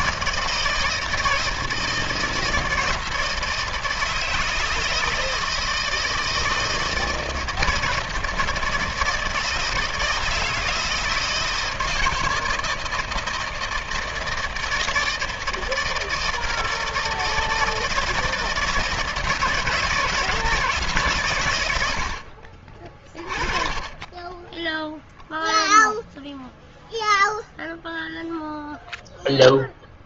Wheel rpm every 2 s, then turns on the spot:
160, 160, 160, 160, 160, 160, 160, 160, 160, 160, 160, 60, 10, 0, 0.
none